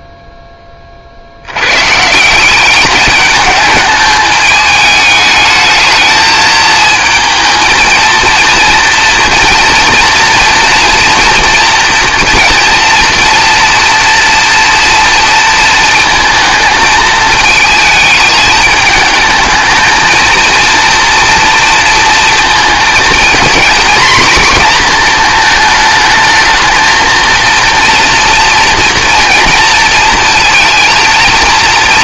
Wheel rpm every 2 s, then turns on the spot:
40, 200, 210, 230, 230, 230, 230, 230, 220, 220, 230, 220, 220, 230, 230, 220.
none